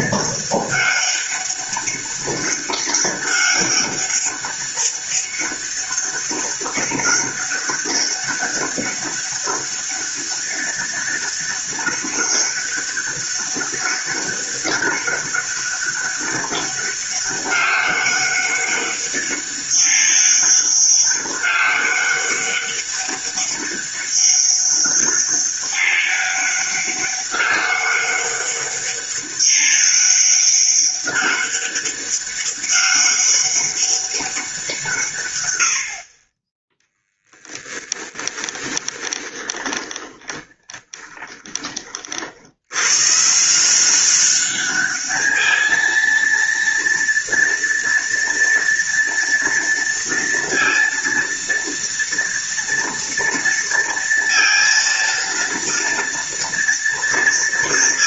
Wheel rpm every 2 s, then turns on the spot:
200, 200, 200, 200, 200, 200, 200, 200, 200, 200, 200, 200, 200, 200, 200, 200, 200, 180, 20, 10, 20, 90, 200, 230, 230, 230, 230, 230, 230.
38-42